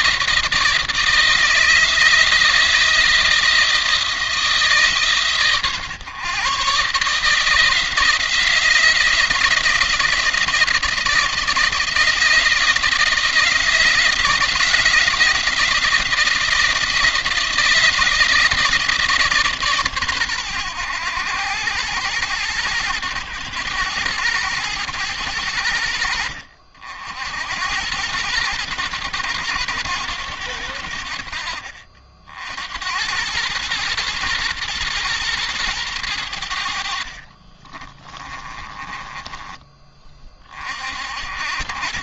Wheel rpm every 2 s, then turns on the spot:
160, 160, 150, 140, 170, 160, 170, 170, 170, 160, 100, 110, 100, 60, 100, 80, 90, 110, 70, 20, 60.
36-40